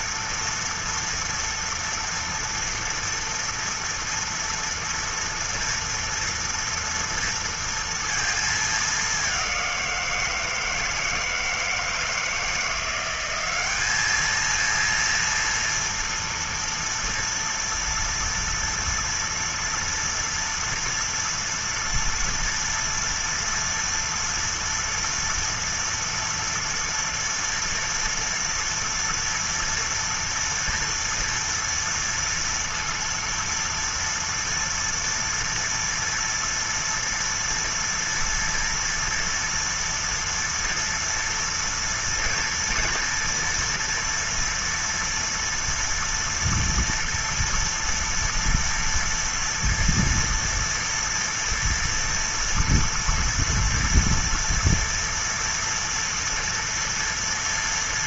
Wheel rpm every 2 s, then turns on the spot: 230, 230, 230, 230, 230, 170, 160, 210, 230, 230, 230, 230, 230, 240, 230, 230, 230, 230, 230, 230, 230, 230, 230, 240, 230, 230, 230, 230, 230.
none